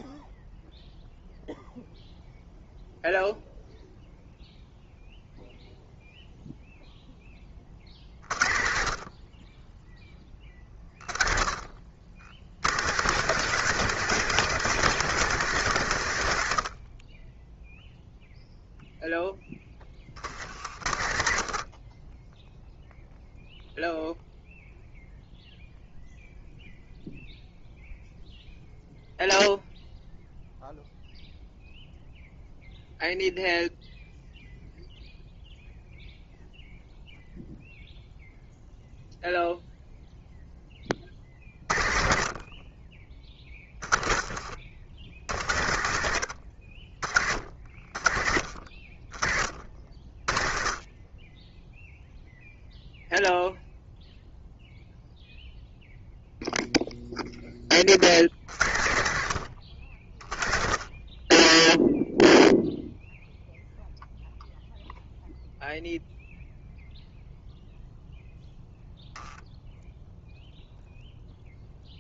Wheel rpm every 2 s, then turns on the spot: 0, 0, 0, 0, 50, 20, 100, 190, 80, 0, 60, 10, 0, 0, 0, 0, 0, 0, 0, 0, 10, 40, 50, 60, 40, 30, 0, 0, 0, 80, 30, 0, 0, 0, 0, 0.
20-22